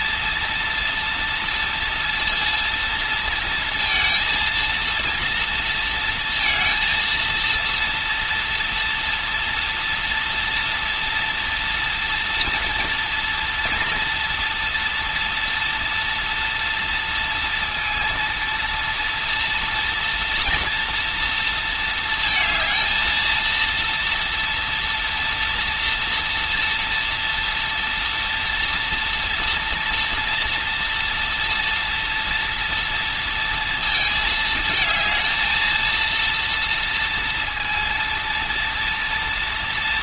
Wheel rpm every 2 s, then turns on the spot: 230, 230, 230, 230, 230, 230, 240, 230, 230, 230, 240, 230, 230, 230, 230, 230, 230, 220, 230, 230.
none